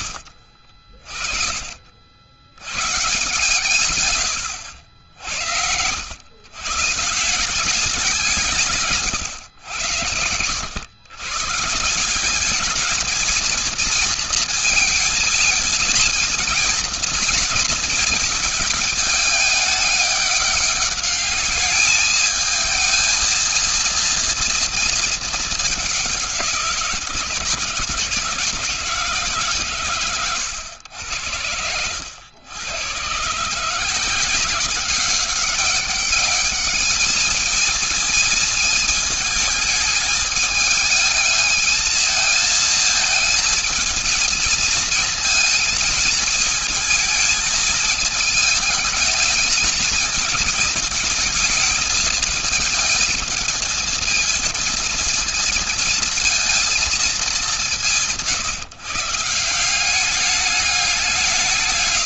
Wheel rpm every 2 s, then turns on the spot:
60, 90, 90, 120, 170, 100, 190, 230, 230, 220, 200, 220, 230, 170, 150, 110, 90, 180, 210, 220, 210, 220, 220, 220, 220, 220, 210, 230, 230, 160, 200.
4-6